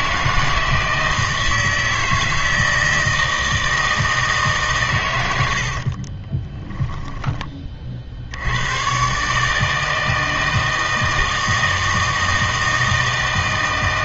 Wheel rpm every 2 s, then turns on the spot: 160, 160, 140, 10, 100, 160, 160.
6-8